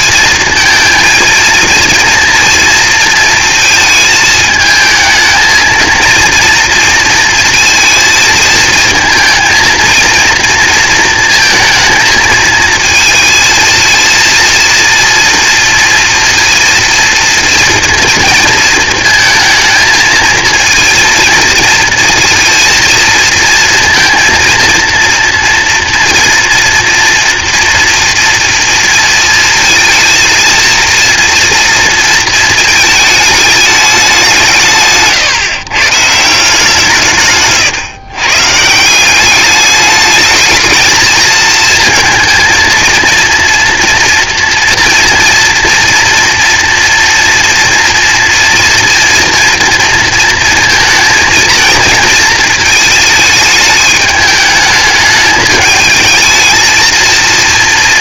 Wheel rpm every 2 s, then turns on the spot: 230, 230, 220, 230, 220, 230, 220, 230, 230, 230, 230, 230, 230, 230, 230, 230, 220, 160, 150, 160, 220, 230, 230, 230, 230, 230, 220, 210, 220.
none